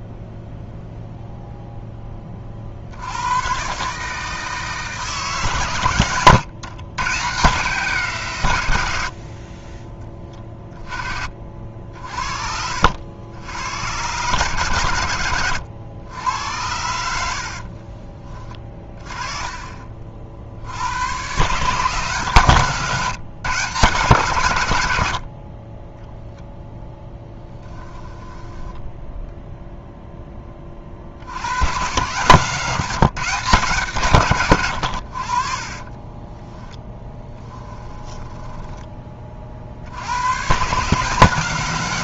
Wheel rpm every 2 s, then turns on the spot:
0, 50, 160, 120, 110, 20, 70, 120, 90, 30, 80, 150, 100, 0, 10, 30, 160, 110, 10, 10, 140.
28-30 34-38